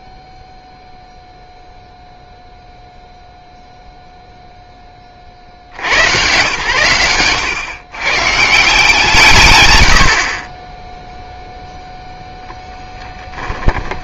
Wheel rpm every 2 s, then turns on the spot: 0, 0, 0, 120, 200, 40, 0.
none